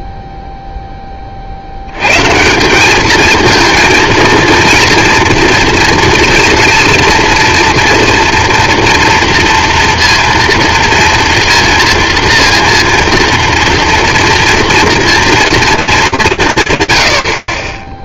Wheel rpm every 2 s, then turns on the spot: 0, 180, 230, 230, 230, 230, 230, 230, 130.
none